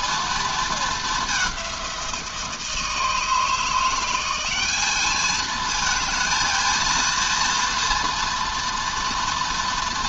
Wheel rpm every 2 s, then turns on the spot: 210, 160, 210, 230, 230.
none